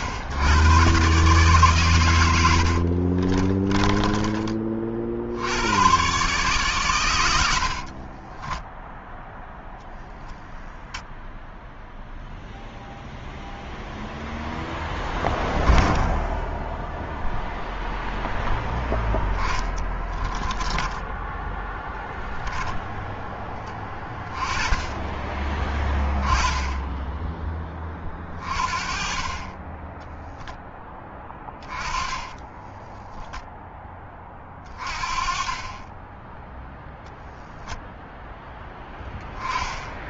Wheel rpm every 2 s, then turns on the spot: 130, 30, 60, 110, 0, 0, 0, 10, 0, 10, 10, 10, 20, 10, 30, 10, 10, 30, 0, 10.
2-4 18-22 30-32